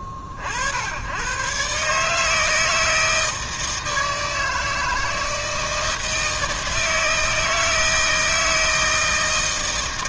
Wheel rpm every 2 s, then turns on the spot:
60, 160, 160, 160, 160.
none